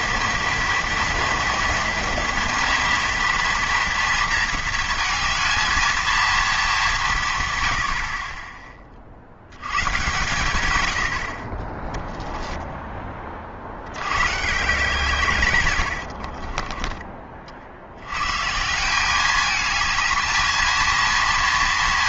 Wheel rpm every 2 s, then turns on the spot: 230, 230, 230, 210, 30, 120, 10, 150, 30, 170, 230.
16-18